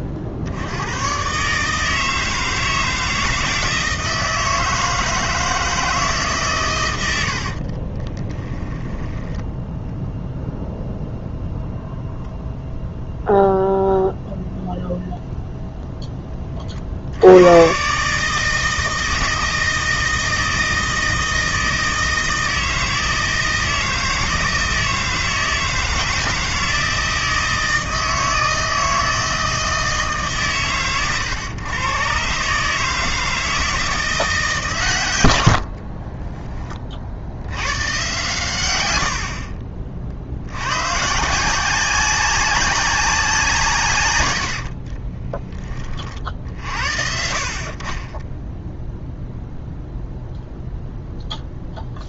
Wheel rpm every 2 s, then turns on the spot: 70, 160, 160, 130, 10, 0, 0, 0, 30, 160, 160, 160, 160, 160, 160, 130, 150, 150, 20, 110, 100, 200, 60, 50, 10, 0.
8-10 44-46 48-50